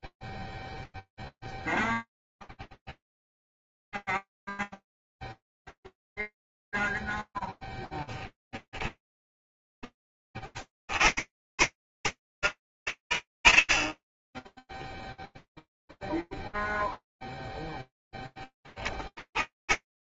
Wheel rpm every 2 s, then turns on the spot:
0, 20, 0, 0, 10, 30, 110, 10, 0, 10.
8-10